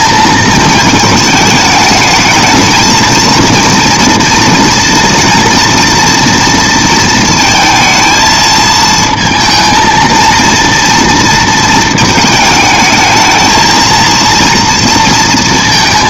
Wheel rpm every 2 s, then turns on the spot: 220, 220, 230, 230, 220, 230, 220, 230.
none